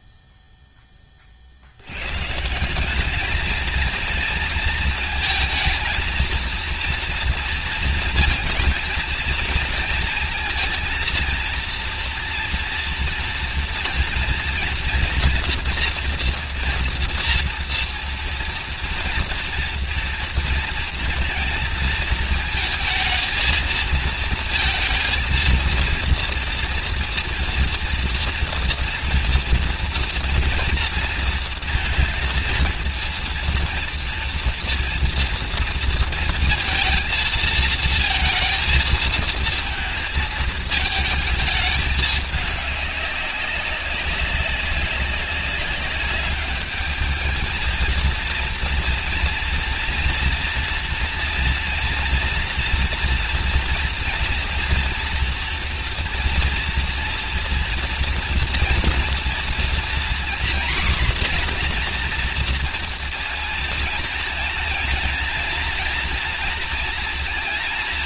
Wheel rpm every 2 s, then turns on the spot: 0, 160, 230, 230, 230, 230, 230, 230, 230, 230, 230, 230, 230, 230, 230, 230, 230, 230, 230, 230, 220, 200, 200, 210, 230, 230, 230, 230, 230, 240, 260, 240, 230, 230.
none